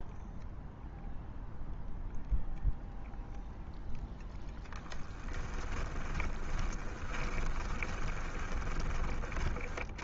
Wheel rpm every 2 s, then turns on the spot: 0, 0, 0, 20, 20.
6-8